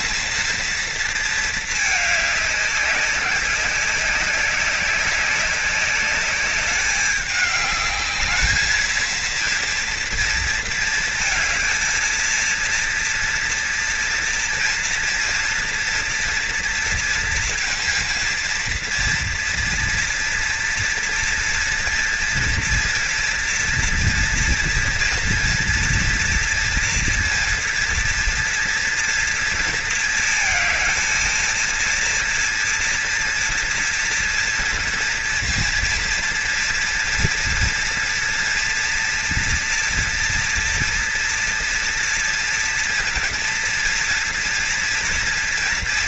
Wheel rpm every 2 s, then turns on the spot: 220, 190, 190, 200, 220, 230, 230, 230, 230, 230, 230, 230, 240, 230, 230, 230, 230, 230, 230, 230, 230, 230, 230.
none